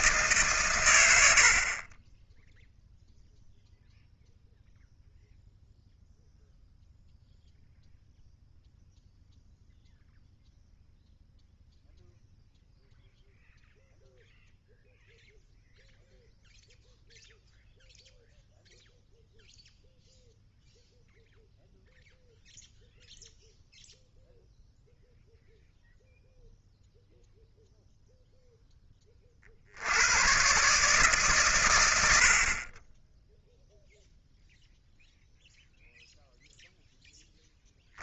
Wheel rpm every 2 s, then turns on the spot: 120, 0, 0, 0, 0, 0, 0, 0, 0, 0, 0, 0, 0, 0, 10, 130, 40, 0, 0.
none